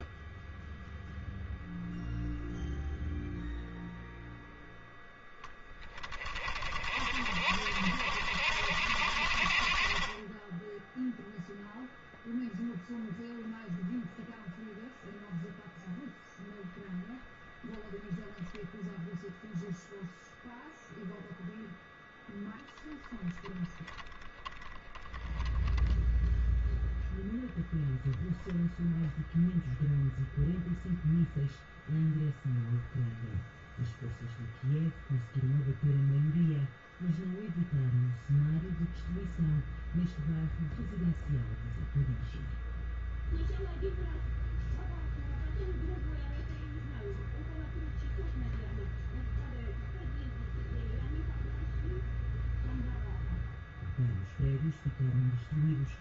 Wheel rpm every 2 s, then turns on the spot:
0, 0, 0, 40, 70, 10, 0, 0, 0, 0, 0, 0, 10, 0, 0, 0, 0, 0, 0, 0, 0, 0, 0, 0, 0, 0, 0, 0.
none